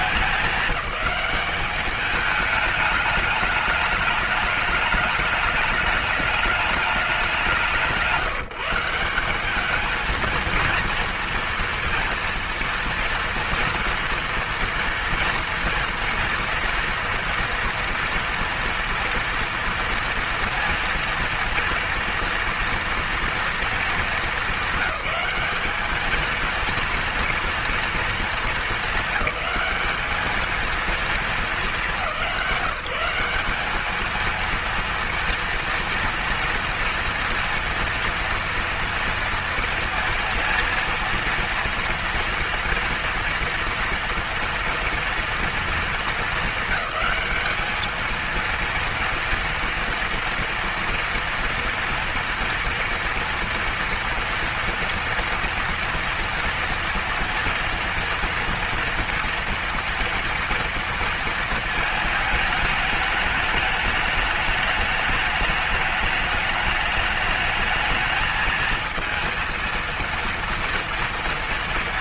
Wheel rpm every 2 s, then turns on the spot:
210, 210, 210, 210, 170, 230, 230, 230, 230, 240, 230, 230, 200, 220, 230, 220, 180, 230, 230, 230, 230, 230, 230, 210, 230, 230, 230, 230, 230, 230, 230, 220, 210, 210, 220, 230.
none